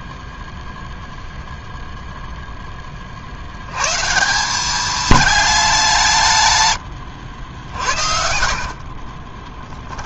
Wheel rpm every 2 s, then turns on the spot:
0, 10, 200, 100, 50.
8-10